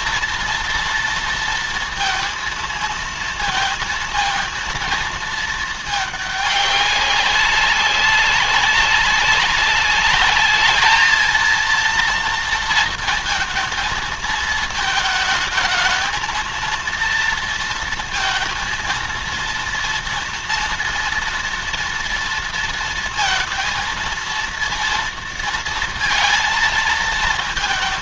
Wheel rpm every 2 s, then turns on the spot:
230, 230, 220, 200, 190, 210, 230, 220, 230, 230, 230, 230, 230, 230.
none